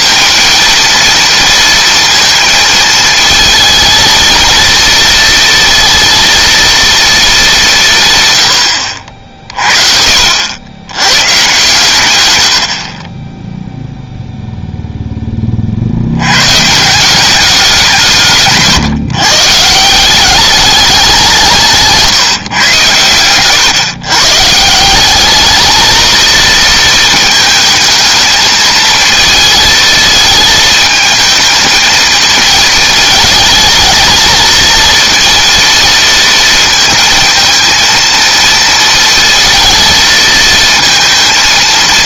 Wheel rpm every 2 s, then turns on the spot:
230, 220, 230, 230, 80, 90, 70, 0, 150, 140, 200, 140, 170, 230, 220, 220, 230, 230, 230, 230, 230.
8-10